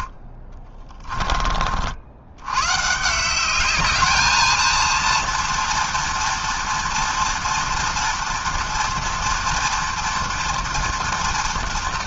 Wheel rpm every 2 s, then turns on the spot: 20, 120, 220, 230, 240, 230.
0-2